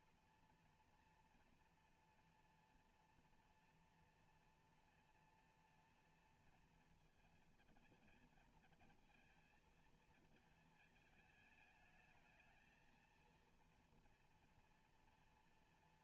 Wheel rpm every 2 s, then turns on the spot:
230, 240, 230, 230, 220, 220, 220, 230.
none